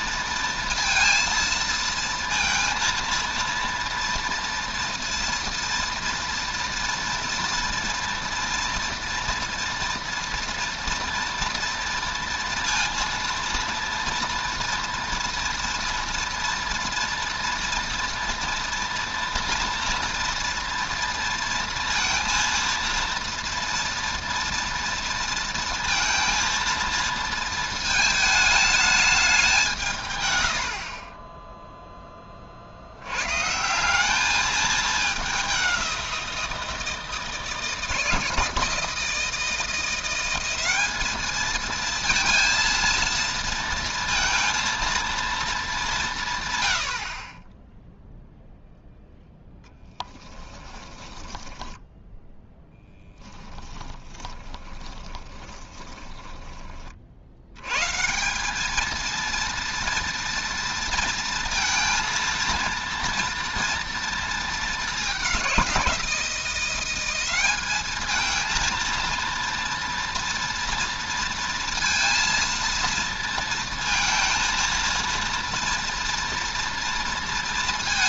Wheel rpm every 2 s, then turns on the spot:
230, 230, 230, 240, 240, 230, 230, 230, 230, 230, 230, 230, 230, 230, 210, 70, 50, 210, 170, 160, 200, 230, 230, 90, 0, 20, 10, 20, 30, 210, 230, 230, 210, 180, 230, 230, 230, 230, 240.
50-56